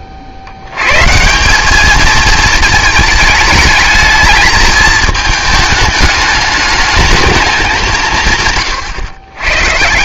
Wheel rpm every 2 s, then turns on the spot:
90, 220, 220, 210, 140.
none